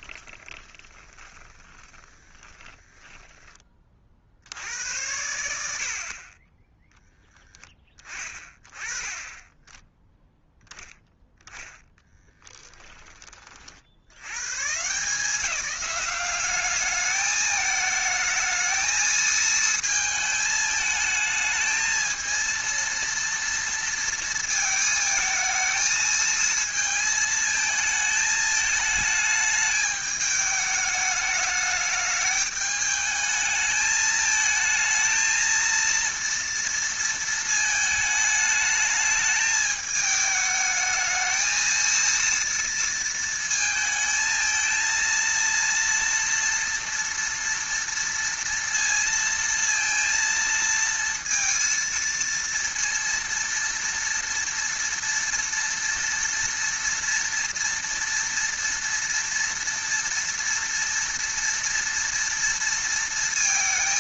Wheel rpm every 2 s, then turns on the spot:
20, 10, 70, 10, 20, 0, 10, 140, 210, 220, 220, 230, 230, 220, 220, 210, 210, 220, 230, 210, 220, 230, 230, 230, 230, 230, 230, 230, 230, 230, 230, 230.
0-4